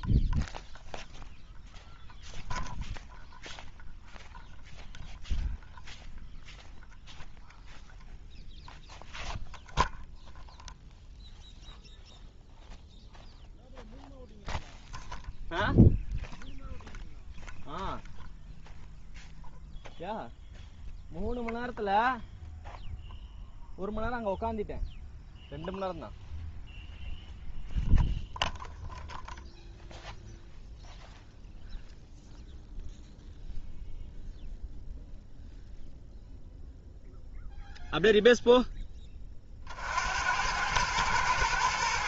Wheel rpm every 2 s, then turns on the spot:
0, 0, 0, 0, 0, 0, 0, 0, 0, 0, 0, 0, 0, 0, 0, 0, 0, 0, 0, 10, 100.
none